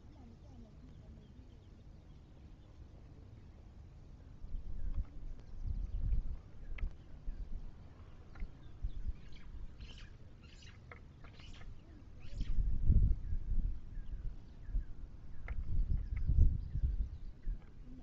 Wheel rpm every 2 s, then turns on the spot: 0, 0, 0, 0, 0, 0, 0, 0, 0.
none